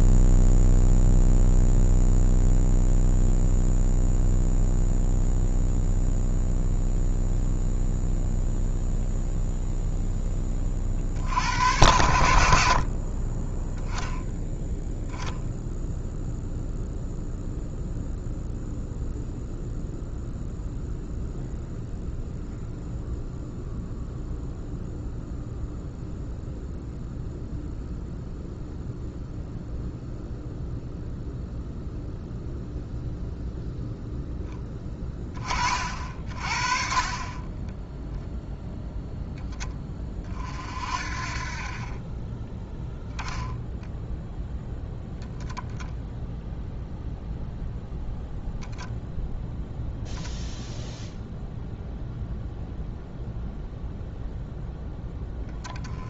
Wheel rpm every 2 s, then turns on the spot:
0, 0, 0, 0, 0, 30, 60, 0, 0, 0, 0, 0, 0, 0, 0, 0, 0, 10, 40, 0, 40, 20, 10, 0, 0, 0, 0, 0.
none